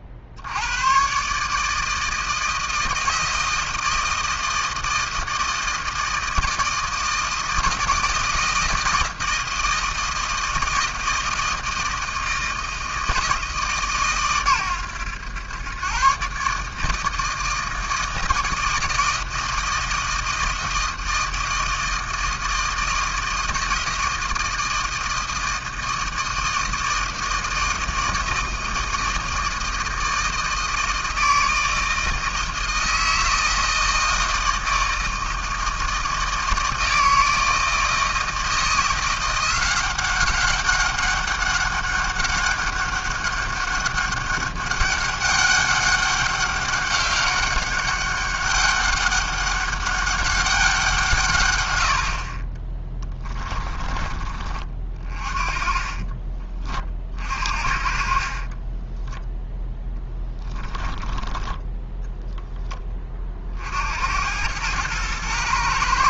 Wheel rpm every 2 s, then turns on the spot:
80, 160, 160, 160, 160, 160, 160, 120, 150, 160, 160, 160, 160, 160, 160, 160, 160, 160, 160, 170, 200, 200, 200, 200, 200, 190, 30, 40, 30, 30, 10, 20, 100.
58-62